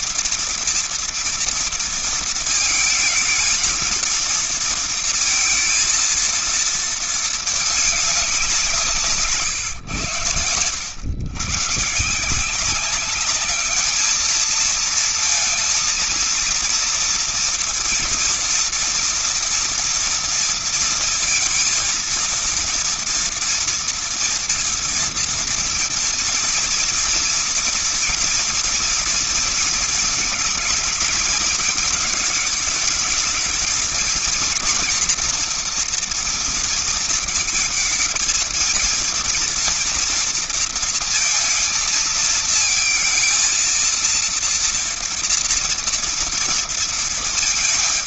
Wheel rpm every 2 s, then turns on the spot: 230, 230, 230, 230, 180, 90, 170, 220, 230, 230, 230, 230, 230, 230, 240, 230, 220, 230, 230, 230, 230, 230, 230, 230.
none